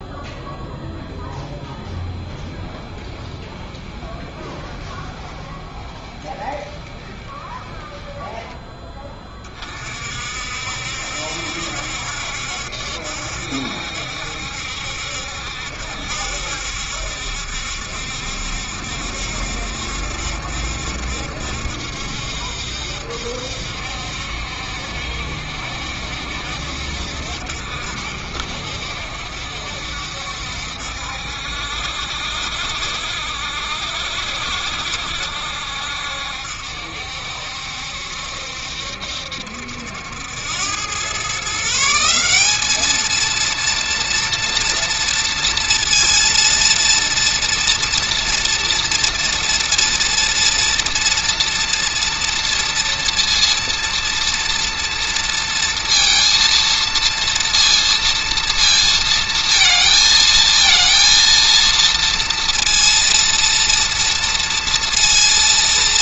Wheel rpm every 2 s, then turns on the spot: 10, 10, 10, 10, 20, 70, 70, 70, 70, 70, 70, 70, 70, 60, 70, 70, 70, 70, 70, 70, 110, 220, 230, 230, 230, 230, 230, 230, 230, 230, 230, 230, 230.
2-8